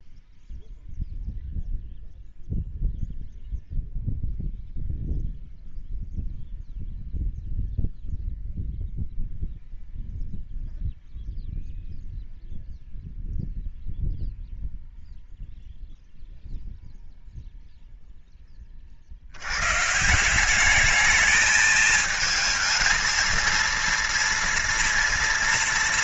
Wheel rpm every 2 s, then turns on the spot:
0, 0, 0, 0, 0, 0, 0, 0, 0, 30, 200, 220, 240.
none